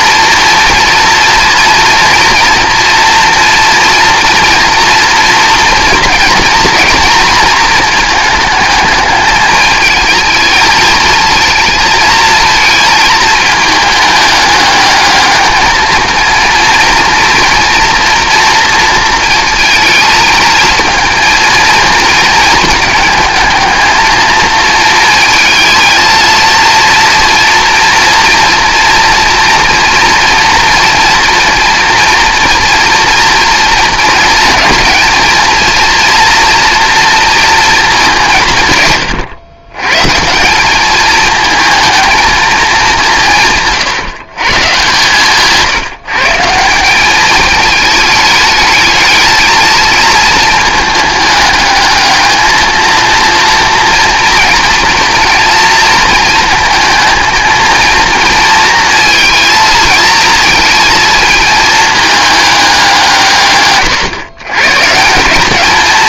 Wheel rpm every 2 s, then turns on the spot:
230, 230, 230, 220, 210, 220, 220, 210, 230, 230, 220, 220, 220, 230, 230, 230, 240, 230, 230, 130, 190, 210, 130, 180, 210, 220, 220, 230, 220, 230, 220, 200, 140.
none